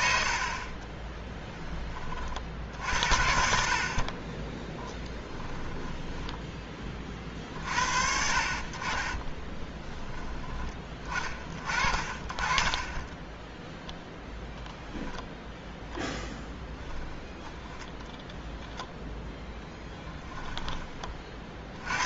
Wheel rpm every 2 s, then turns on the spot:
30, 60, 10, 20, 40, 10, 20, 0, 10, 0, 20.
0-2 4-6 12-14 16-18